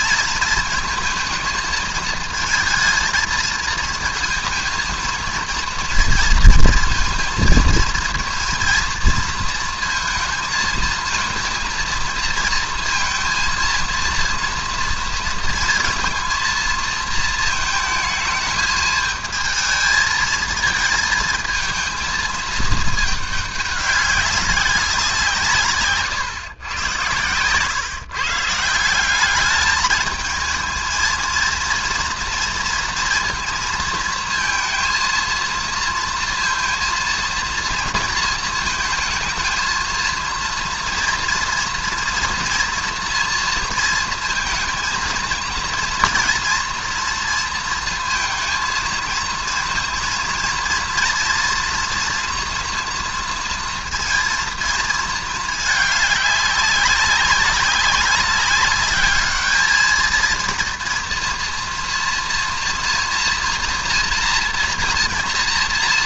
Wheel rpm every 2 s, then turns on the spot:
220, 230, 230, 230, 230, 220, 230, 230, 230, 220, 220, 220, 200, 120, 150, 220, 230, 230, 230, 230, 230, 230, 230, 230, 230, 230, 240, 230, 200, 200, 230, 230, 230.
none